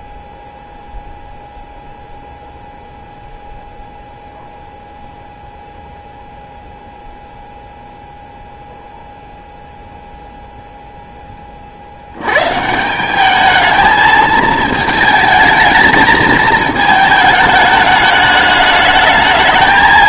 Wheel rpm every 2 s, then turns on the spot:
0, 0, 0, 0, 0, 0, 150, 220, 220, 210.
none